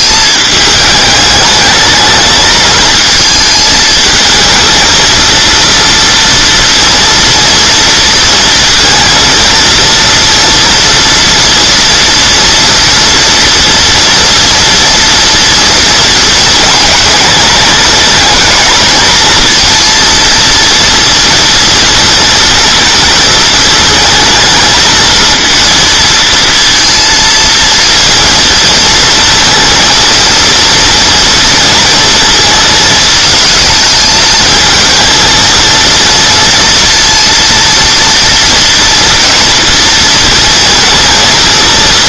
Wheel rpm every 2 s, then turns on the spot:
210, 220, 230, 230, 230, 230, 230, 230, 220, 220, 230, 220, 220, 230, 230, 230, 220, 220, 230, 230, 230.
none